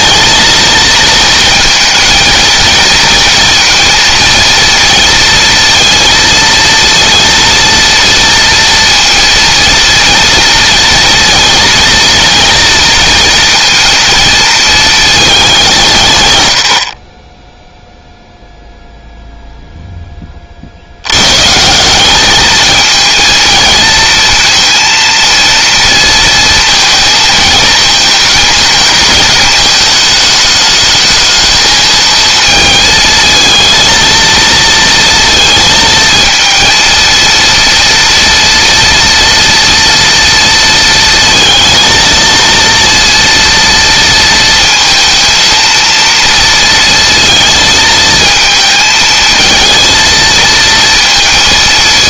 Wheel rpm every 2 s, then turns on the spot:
230, 230, 230, 230, 230, 230, 230, 220, 50, 0, 90, 230, 230, 220, 220, 220, 220, 230, 230, 230, 230, 230, 230, 230, 220, 230.
none